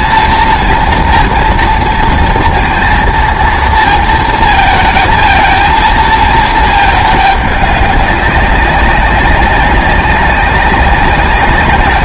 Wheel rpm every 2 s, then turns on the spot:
230, 230, 220, 220, 190, 190.
none